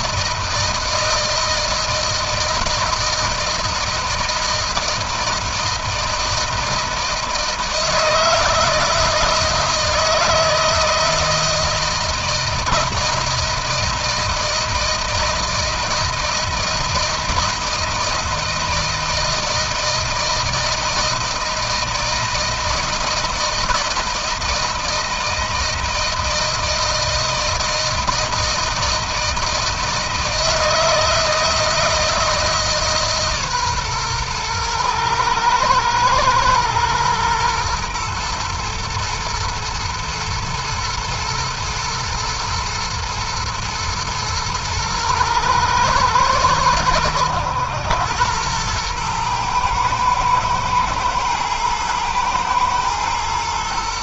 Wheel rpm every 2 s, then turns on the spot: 160, 160, 160, 160, 160, 160, 160, 160, 160, 160, 160, 160, 160, 160, 160, 160, 160, 120, 110, 110, 110, 110, 110, 110, 110, 110, 110.
none